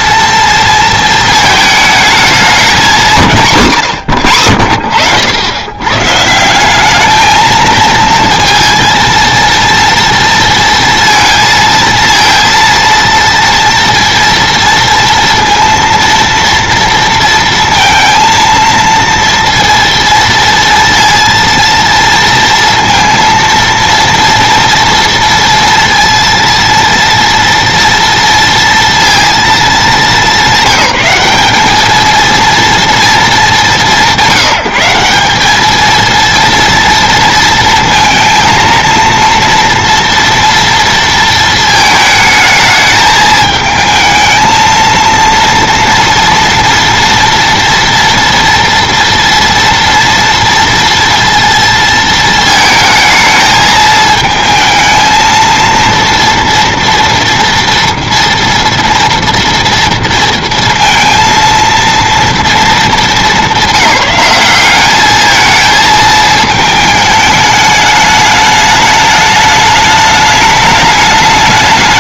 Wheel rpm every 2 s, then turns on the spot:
230, 210, 80, 190, 230, 230, 230, 230, 230, 230, 230, 230, 230, 230, 230, 200, 230, 180, 230, 230, 230, 220, 220, 230, 240, 230, 220, 220, 240, 230, 230, 230, 200, 220, 210, 210.
none